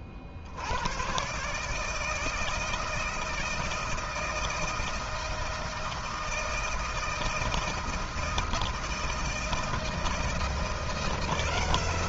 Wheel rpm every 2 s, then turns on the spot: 50, 160, 160, 160, 160, 160.
none